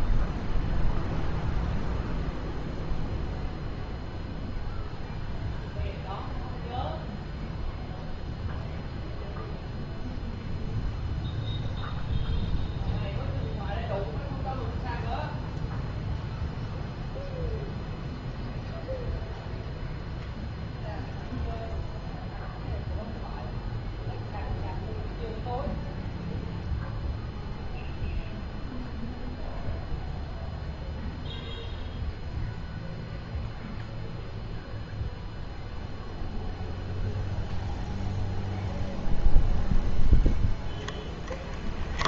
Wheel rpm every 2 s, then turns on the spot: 0, 0, 0, 0, 0, 0, 0, 0, 0, 0, 0, 0, 0, 0, 0, 0, 0, 0, 0, 0, 0.
none